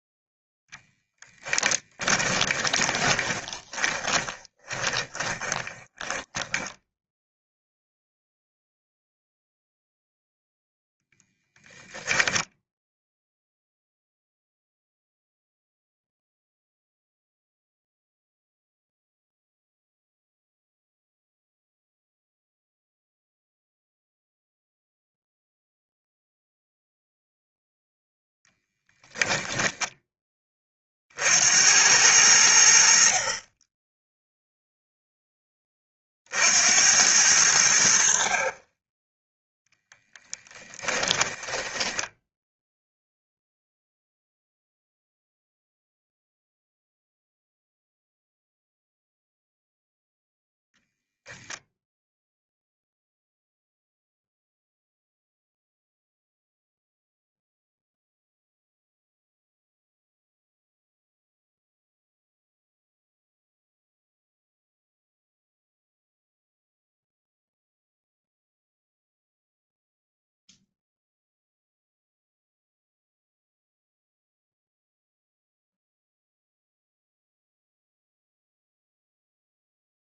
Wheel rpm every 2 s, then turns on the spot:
10, 20, 20, 10, 0, 10, 0, 0, 0, 0, 0, 0, 0, 0, 10, 50, 60, 0, 80, 20, 30, 0, 0, 0, 0, 0, 0, 0, 0, 0, 0, 0, 0, 0, 0, 0, 0, 0, 0, 0.
0-8 10-12 40-42